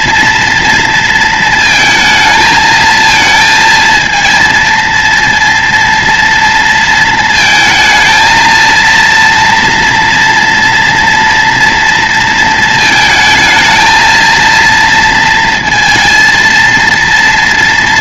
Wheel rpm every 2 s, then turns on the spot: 220, 230, 230, 230, 230, 230, 220, 230, 230.
none